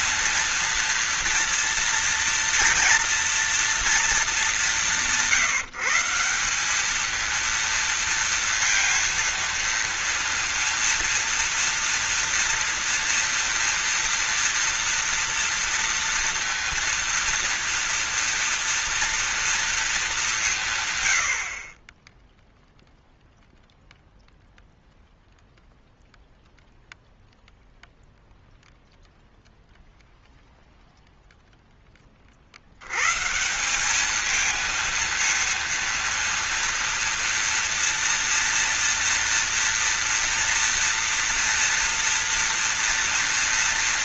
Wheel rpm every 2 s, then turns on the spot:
230, 230, 200, 180, 230, 230, 230, 230, 230, 230, 170, 0, 0, 0, 0, 0, 60, 220, 230, 230, 230, 230.
none